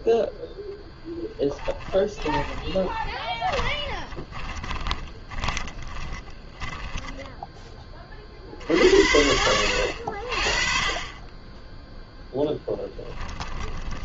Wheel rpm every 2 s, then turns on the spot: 0, 20, 20, 10, 40, 50, 0.
2-8